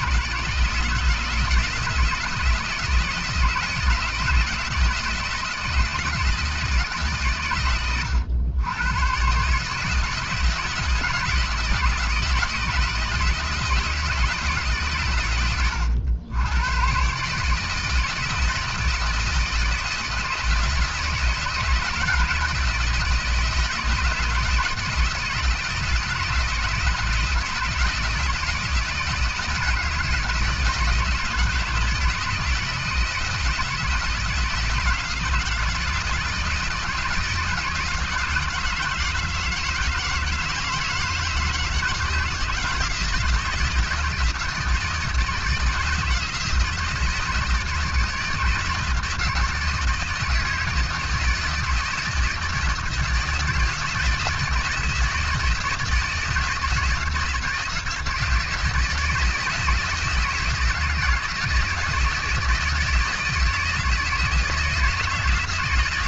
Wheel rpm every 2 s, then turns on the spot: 150, 160, 160, 160, 100, 160, 160, 140, 100, 160, 160, 160, 170, 160, 160, 160, 160, 170, 170, 160, 160, 160, 160, 160, 160, 160, 160, 160, 160, 160, 160, 160, 160.
none